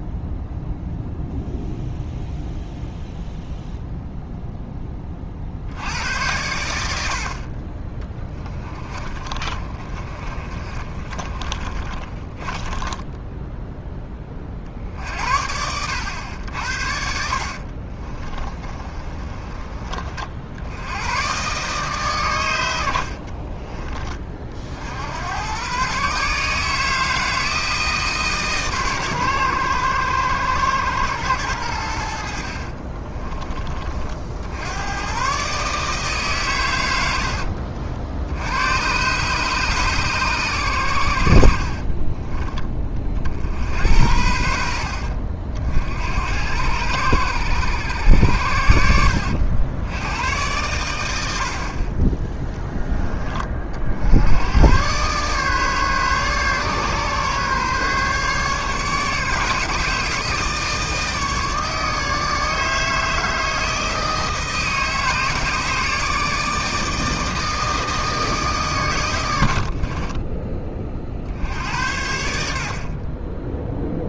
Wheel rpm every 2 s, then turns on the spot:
0, 0, 20, 70, 30, 30, 10, 60, 70, 30, 90, 90, 70, 160, 130, 110, 30, 100, 90, 120, 90, 40, 70, 100, 80, 90, 10, 120, 140, 150, 150, 160, 160, 160, 110, 30, 50.
8-14 16-20 32-34